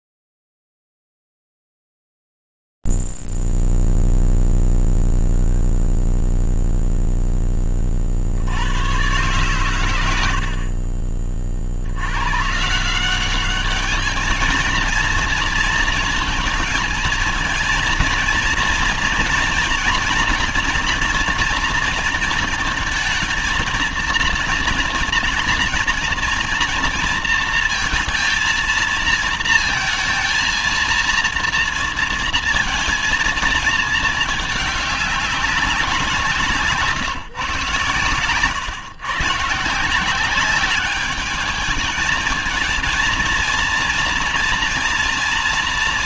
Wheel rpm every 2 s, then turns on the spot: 0, 0, 0, 0, 30, 110, 90, 210, 230, 230, 230, 230, 230, 230, 220, 230, 230, 210, 180, 130, 180, 220, 230.
none